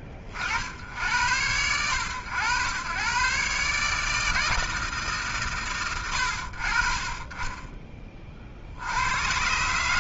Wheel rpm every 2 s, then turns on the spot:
30, 100, 160, 60, 50.
none